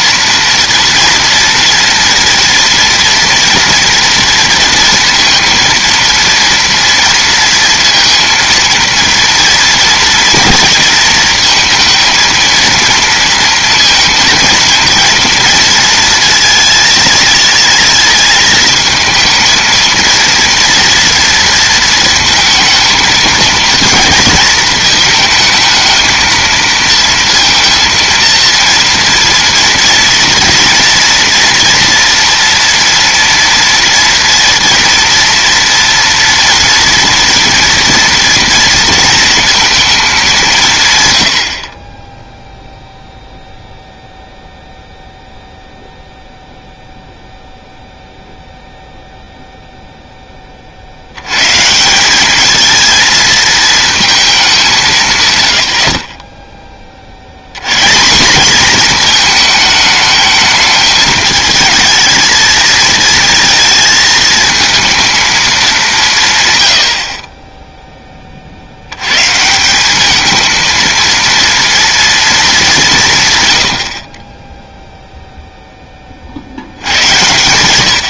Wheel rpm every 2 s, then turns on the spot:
230, 230, 230, 230, 230, 230, 230, 230, 230, 220, 230, 220, 230, 220, 230, 230, 230, 230, 230, 230, 180, 0, 0, 0, 0, 30, 220, 190, 20, 210, 220, 230, 220, 110, 70, 230, 200, 10, 70.
none